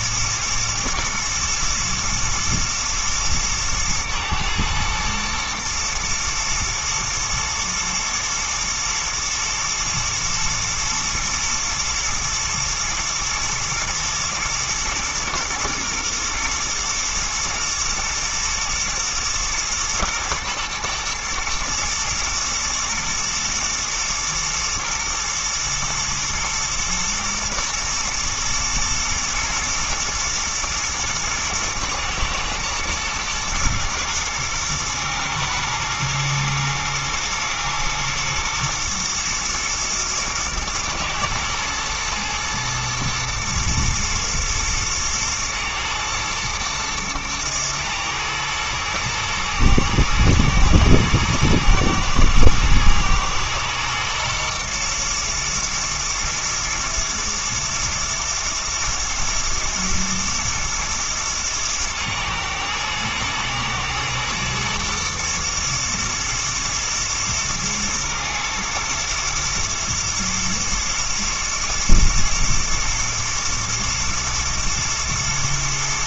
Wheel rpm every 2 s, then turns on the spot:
110, 110, 110, 120, 110, 110, 110, 120, 120, 120, 120, 110, 110, 120, 110, 110, 120, 110, 120, 110, 110, 120, 110, 110, 120, 110, 110, 120, 110, 110, 120, 110, 110, 120, 110, 110, 110, 120.
none